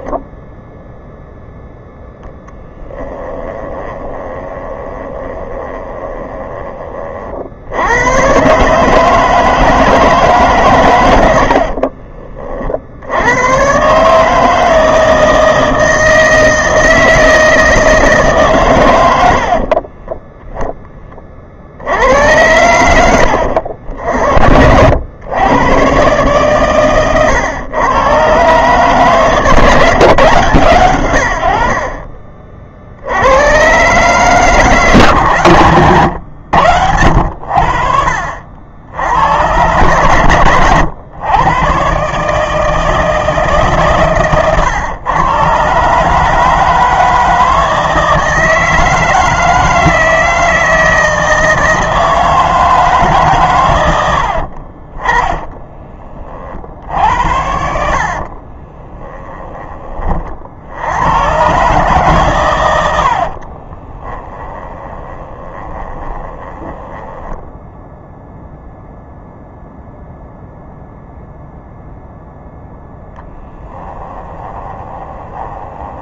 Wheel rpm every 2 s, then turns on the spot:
0, 10, 20, 30, 150, 120, 60, 160, 160, 120, 10, 90, 90, 130, 130, 110, 60, 140, 80, 80, 110, 160, 120, 160, 160, 160, 150, 40, 60, 20, 80, 80, 20, 10, 0, 0, 0, 20.
2-6 58-60 64-68 74-76